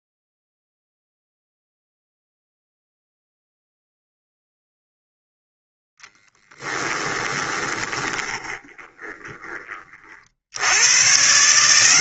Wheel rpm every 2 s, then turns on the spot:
0, 0, 0, 10, 20, 70.
6-10